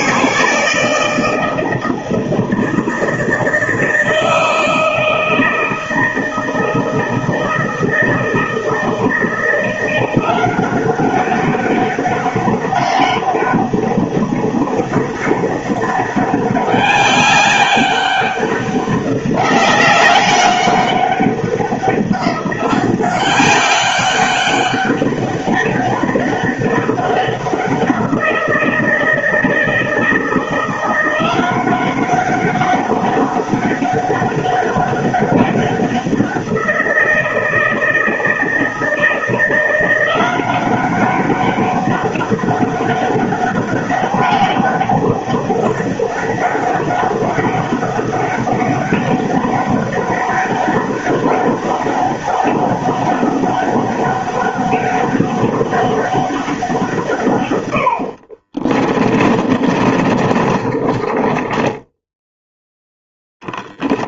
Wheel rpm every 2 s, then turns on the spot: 160, 160, 160, 160, 160, 190, 200, 200, 200, 190, 200, 190, 200, 200, 160, 170, 200, 200, 170, 160, 190, 200, 200, 200, 200, 200, 200, 200, 160, 30, 30, 0.
58-62